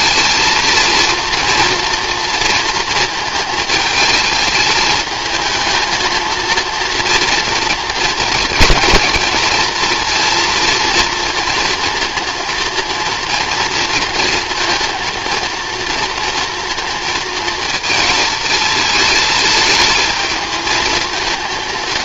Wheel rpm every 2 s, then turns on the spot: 230, 230, 210, 230, 230, 230, 230, 230, 230, 220, 230.
none